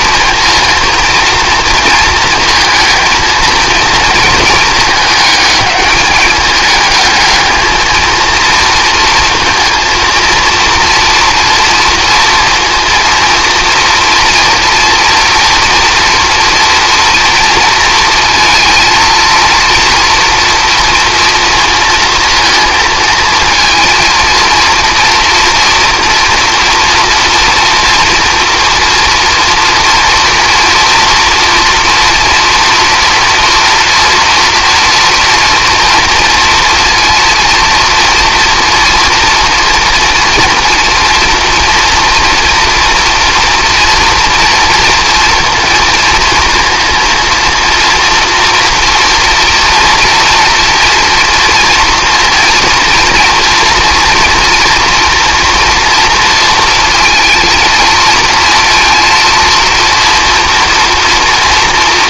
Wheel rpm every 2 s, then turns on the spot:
230, 220, 220, 210, 230, 230, 230, 240, 240, 230, 230, 230, 230, 230, 240, 230, 230, 230, 230, 230, 230, 230, 230, 230, 240, 230, 230, 240, 230, 230, 240.
none